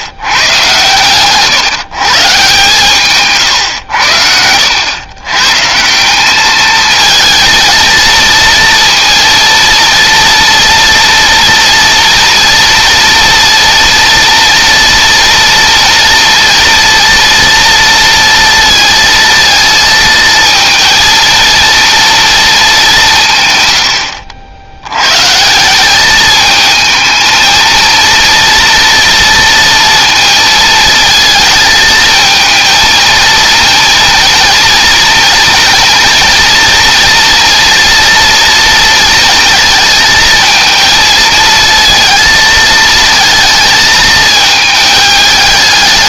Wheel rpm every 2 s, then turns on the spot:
130, 140, 120, 220, 230, 230, 230, 230, 230, 230, 230, 150, 130, 220, 230, 220, 230, 230, 230, 230, 230, 220, 210.
none